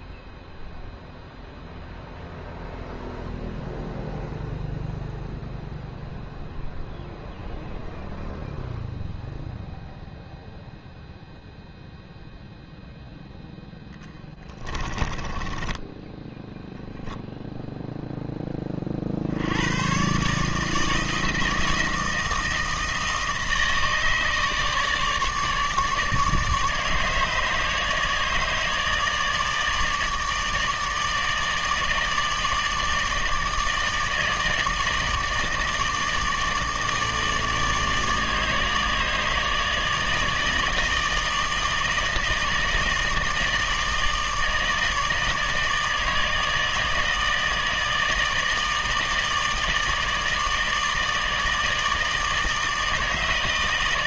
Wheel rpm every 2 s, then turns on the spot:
0, 0, 0, 0, 0, 0, 10, 10, 0, 110, 160, 160, 150, 150, 150, 150, 160, 160, 150, 160, 160, 160, 160, 160, 160, 160, 160.
12-16